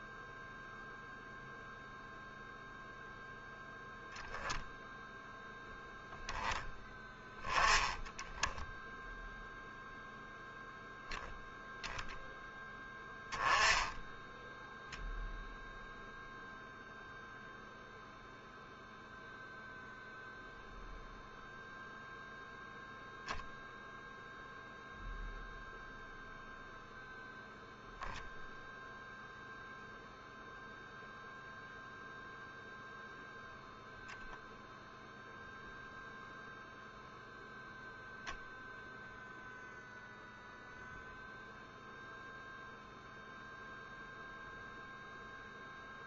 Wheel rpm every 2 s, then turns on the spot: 0, 0, 0, 0, 0, 0, 0, 0, 0, 0, 0, 0, 0, 0, 0, 0, 0, 0, 0, 0, 0, 0, 0.
none